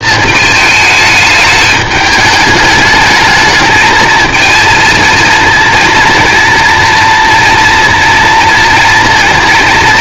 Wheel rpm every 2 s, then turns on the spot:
220, 210, 220, 230, 220.
none